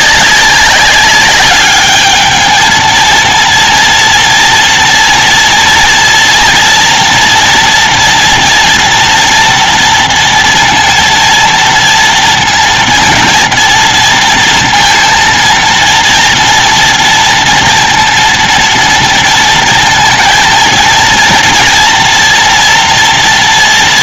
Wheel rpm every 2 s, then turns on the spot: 190, 210, 230, 230, 240, 230, 230, 230, 230, 230, 230, 240.
none